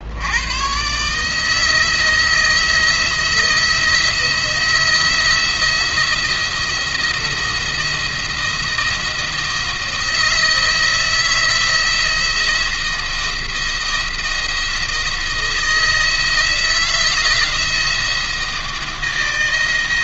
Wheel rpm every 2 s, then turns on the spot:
110, 160, 170, 170, 170, 160, 170, 170, 170, 160.
none